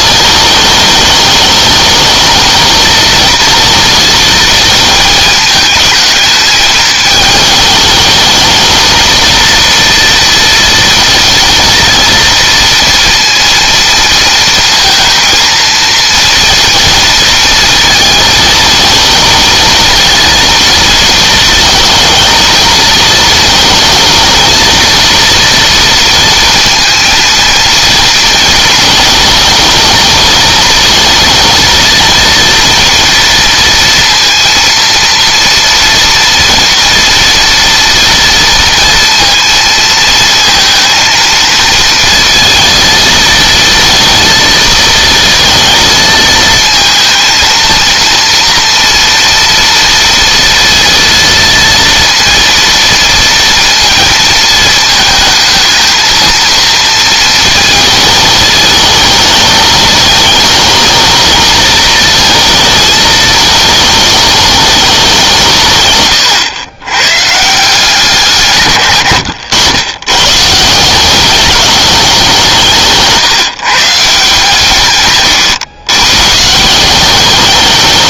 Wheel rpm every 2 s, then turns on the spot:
220, 230, 220, 220, 230, 230, 230, 230, 230, 220, 230, 220, 230, 230, 220, 220, 230, 230, 230, 230, 230, 230, 230, 220, 230, 230, 230, 220, 230, 220, 220, 220, 210, 120, 120, 170, 160, 140, 170.
none